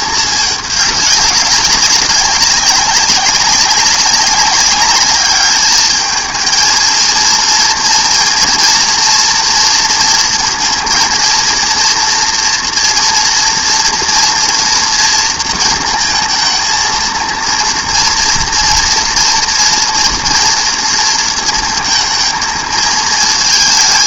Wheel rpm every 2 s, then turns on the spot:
210, 200, 200, 230, 230, 230, 230, 230, 220, 230, 230, 220.
none